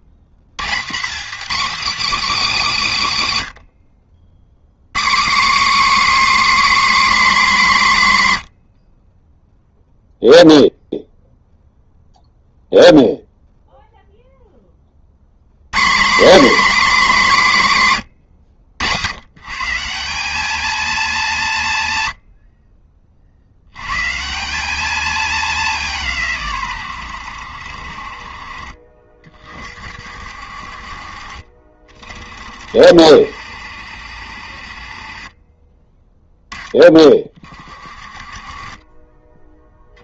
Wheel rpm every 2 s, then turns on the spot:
190, 270, 130, 300, 80, 0, 0, 40, 260, 100, 220, 40, 200, 120, 50, 50, 60, 50, 30, 30.
none